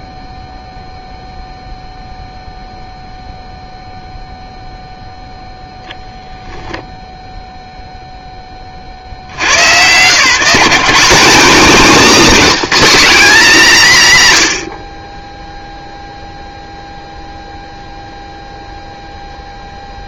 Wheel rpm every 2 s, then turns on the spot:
10, 0, 0, 0, 80, 210, 240, 40, 0, 0.
none